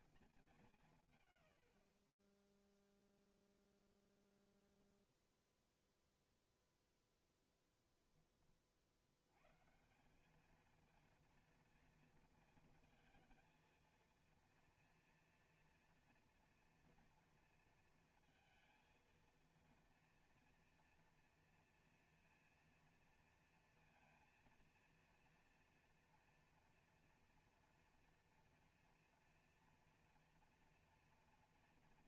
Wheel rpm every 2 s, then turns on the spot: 0, 0, 0, 0, 160, 230, 230, 230, 230, 230, 230, 230, 230, 230, 230, 240.
none